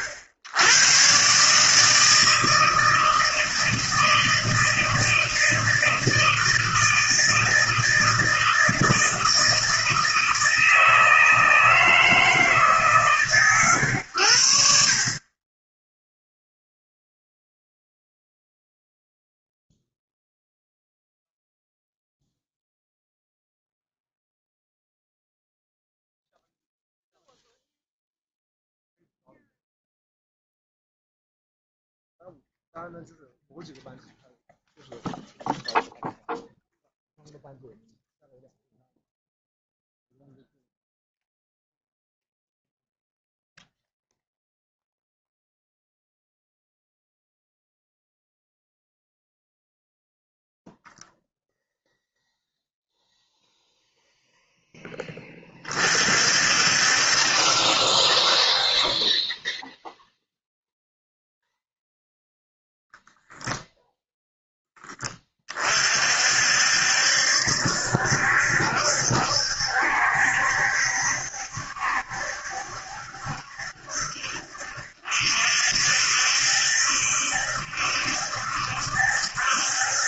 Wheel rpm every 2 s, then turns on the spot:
90, 160, 160, 160, 160, 160, 150, 70, 0, 0, 0, 0, 0, 0, 0, 0, 0, 0, 0, 0, 0, 0, 0, 0, 0, 0, 0, 0, 60, 40, 0, 0, 0, 60, 70, 70, 70, 60, 70, 70.
none